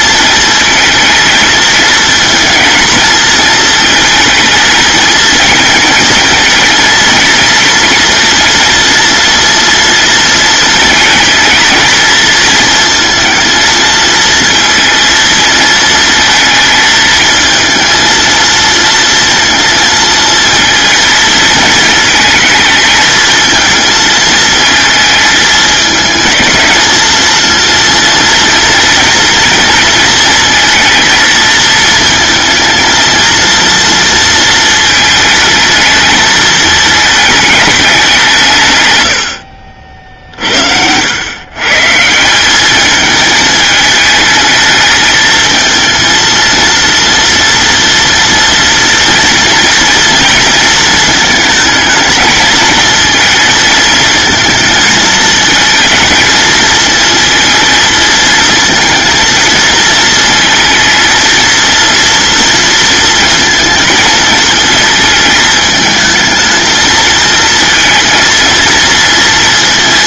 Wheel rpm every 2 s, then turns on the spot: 230, 230, 220, 230, 230, 230, 230, 230, 220, 230, 230, 220, 220, 220, 230, 230, 230, 220, 220, 70, 100, 220, 220, 230, 230, 220, 220, 220, 220, 230, 230, 230, 220, 220, 230.
none